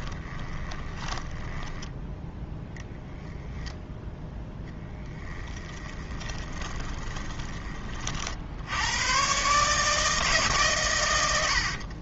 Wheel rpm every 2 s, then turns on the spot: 20, 10, 10, 20, 90, 120.
0-2 4-8